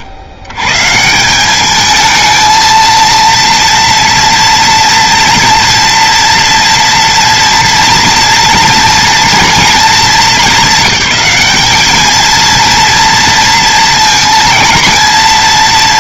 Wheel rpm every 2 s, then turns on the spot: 120, 220, 230, 230, 240, 210, 230, 230.
none